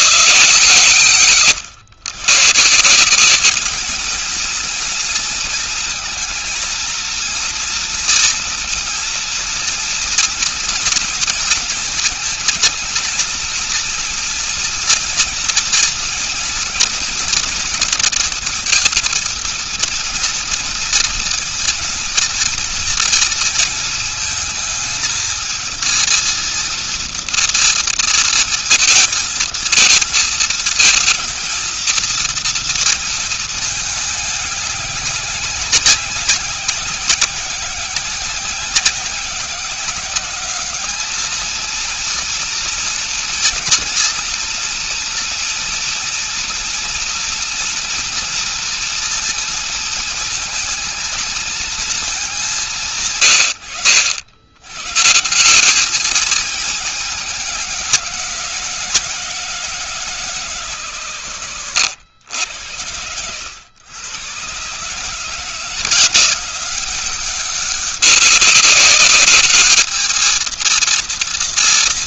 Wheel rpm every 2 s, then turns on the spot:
120, 170, 230, 230, 230, 230, 220, 230, 240, 230, 230, 230, 220, 230, 230, 220, 230, 200, 190, 190, 210, 230, 230, 230, 230, 220, 140, 140, 200, 180, 130, 100, 140, 180, 200, 230.
none